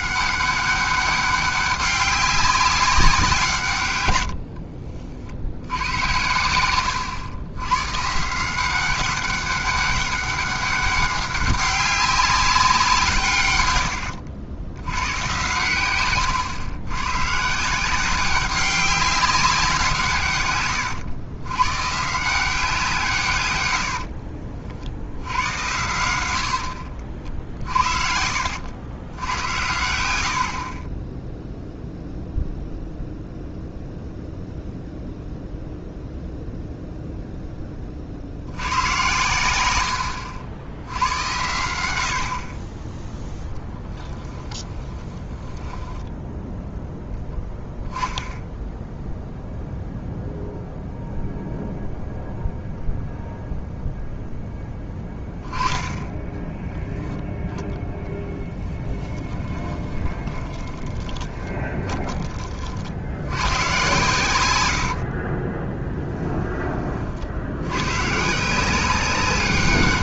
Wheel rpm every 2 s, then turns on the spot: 200, 200, 60, 110, 190, 200, 180, 90, 110, 190, 100, 160, 60, 70, 80, 50, 0, 0, 0, 110, 80, 20, 10, 0, 0, 0, 0, 10, 10, 10, 20, 60, 70, 30, 180.
4-6 26-28 44-46 58-62 64-66